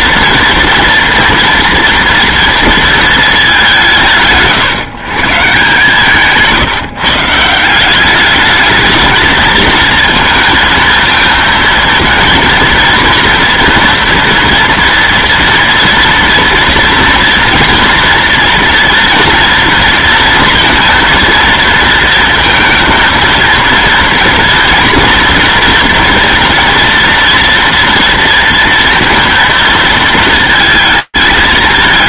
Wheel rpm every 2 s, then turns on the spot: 230, 230, 150, 160, 200, 220, 230, 230, 230, 230, 230, 230, 230, 230, 230, 230.
6-8